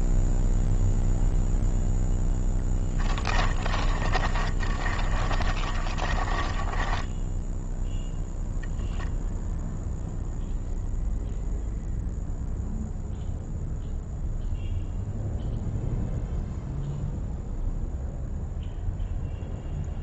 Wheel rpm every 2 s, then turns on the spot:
0, 20, 30, 20, 0, 0, 0, 0, 0, 0.
2-8